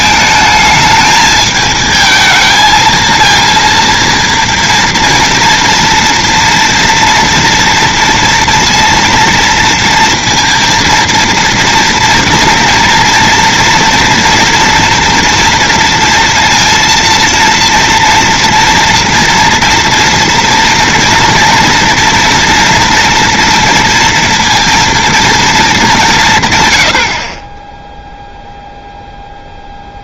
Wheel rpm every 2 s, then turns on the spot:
220, 220, 230, 230, 230, 230, 230, 230, 230, 230, 230, 230, 230, 100, 0.
none